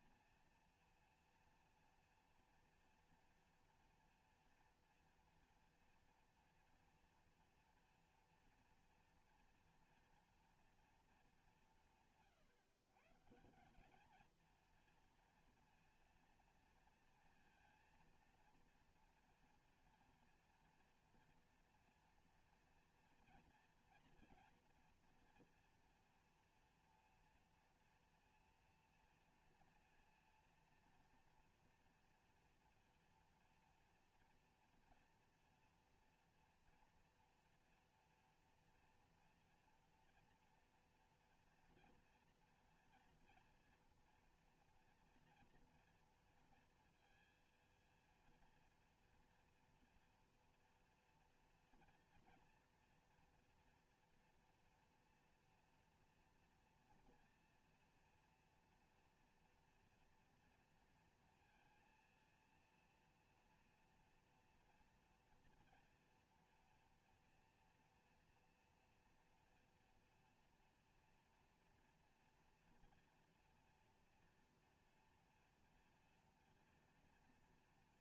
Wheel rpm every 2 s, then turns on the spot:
230, 230, 230, 230, 230, 230, 160, 230, 230, 230, 240, 240, 230, 230, 230, 230, 230, 230, 230, 240, 230, 240, 230, 230, 230, 230, 230, 230, 230, 230, 230, 230, 230, 230, 230, 230, 230, 240, 240.
none